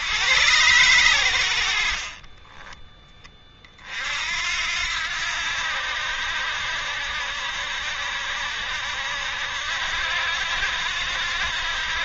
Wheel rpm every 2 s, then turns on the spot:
100, 20, 70, 70, 70, 80.
2-4